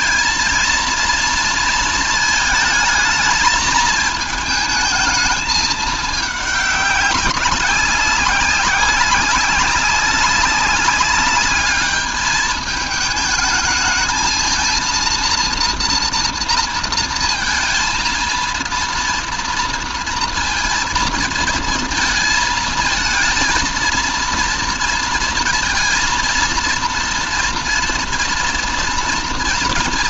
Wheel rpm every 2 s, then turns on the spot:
230, 220, 220, 200, 190, 190, 220, 230, 230, 230, 230, 230, 230, 230, 240.
none